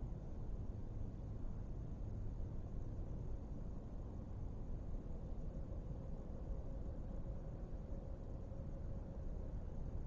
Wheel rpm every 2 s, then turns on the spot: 0, 0, 0, 0, 0.
none